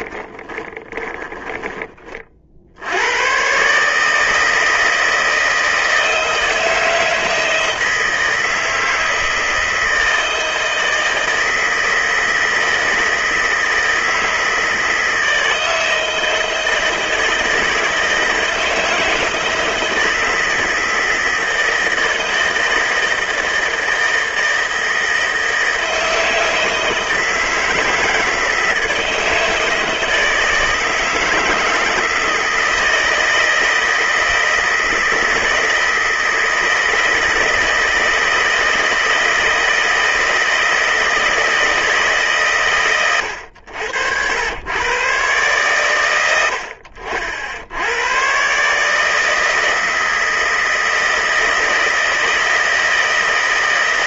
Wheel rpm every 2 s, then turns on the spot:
20, 80, 160, 160, 160, 160, 160, 160, 160, 160, 160, 160, 160, 160, 160, 160, 160, 160, 160, 160, 160, 130, 110, 70, 140, 160, 160.
0-2